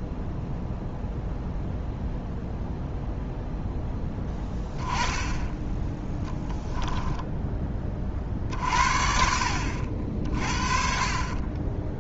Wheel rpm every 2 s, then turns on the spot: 0, 0, 20, 10, 50, 40.
6-8